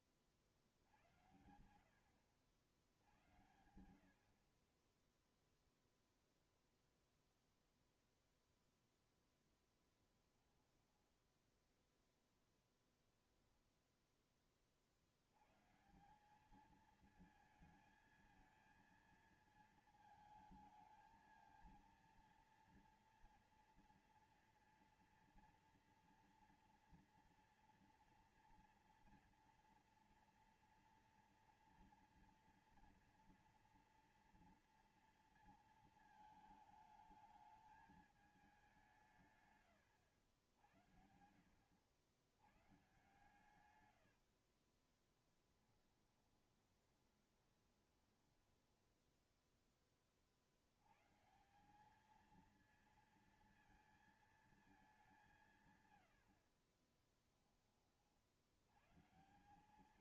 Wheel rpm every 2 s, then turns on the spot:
30, 70, 40, 0, 0, 10, 10, 20, 190, 220, 220, 230, 230, 230, 230, 230, 240, 230, 220, 200, 90, 100, 60, 20, 10, 60, 220, 220, 60, 60.
10-12 44-50 56-58